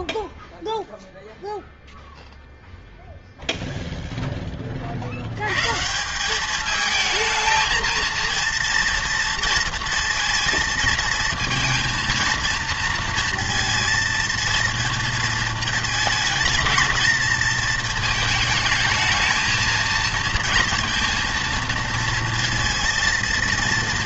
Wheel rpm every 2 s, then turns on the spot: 0, 0, 30, 210, 230, 230, 230, 230, 220, 220, 230, 230.
none